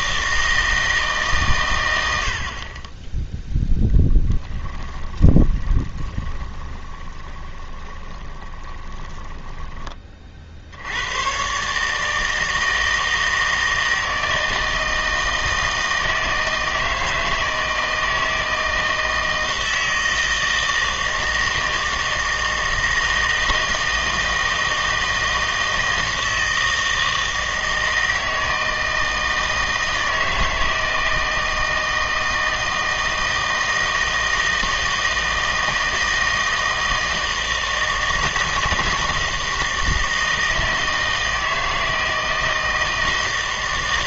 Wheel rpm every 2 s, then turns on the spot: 160, 30, 20, 20, 20, 70, 160, 160, 160, 160, 160, 160, 160, 160, 160, 160, 160, 160, 160, 160, 160, 160.
4-10